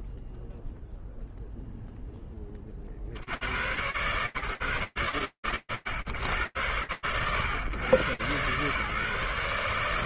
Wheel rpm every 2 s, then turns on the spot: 0, 20, 140, 120, 120.
none